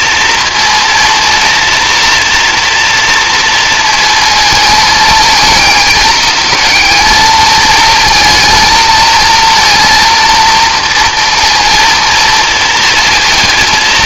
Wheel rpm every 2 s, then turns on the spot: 230, 230, 220, 220, 220, 230, 230.
none